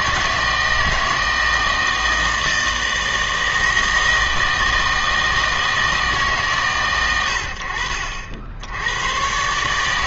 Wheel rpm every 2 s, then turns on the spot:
160, 160, 160, 130, 80.
none